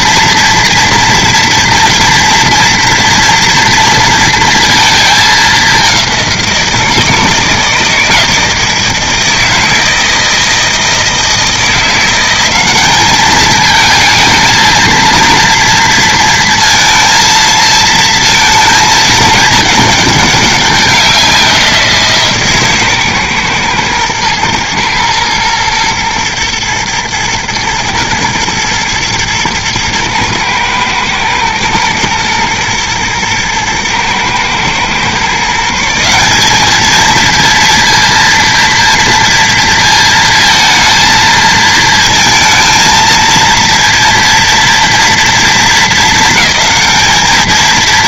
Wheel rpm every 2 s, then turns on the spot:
230, 230, 220, 160, 160, 160, 200, 230, 230, 210, 190, 140, 120, 110, 110, 110, 120, 130, 220, 230, 230, 230, 230, 220.
none